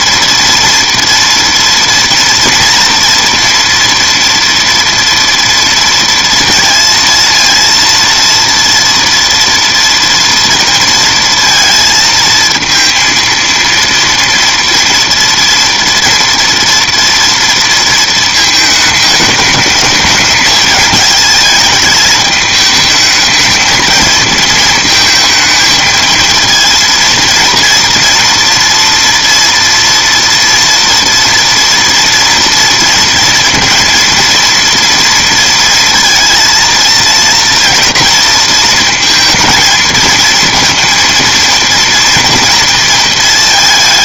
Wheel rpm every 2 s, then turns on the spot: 230, 230, 230, 230, 230, 230, 230, 230, 230, 220, 220, 210, 220, 230, 230, 230, 230, 230, 230, 230, 230, 230.
none